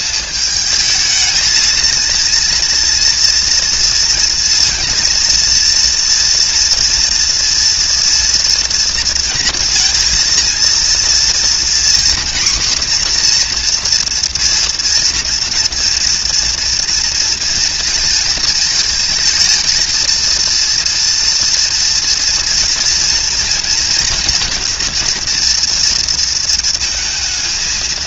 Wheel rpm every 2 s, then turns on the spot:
220, 230, 230, 230, 240, 230, 250, 230, 230, 230, 230, 230, 240, 230.
none